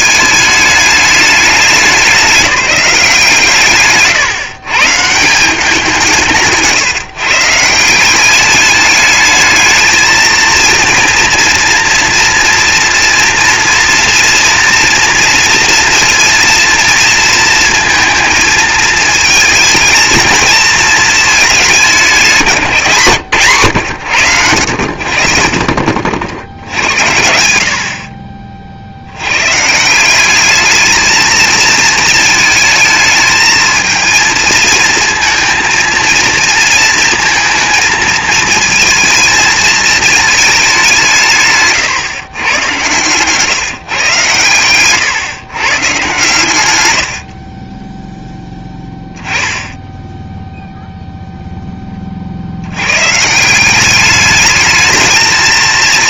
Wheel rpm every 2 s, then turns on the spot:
210, 190, 140, 140, 210, 230, 240, 240, 230, 220, 220, 160, 90, 80, 40, 220, 220, 230, 230, 230, 200, 130, 120, 110, 10, 0, 80, 210.
44-46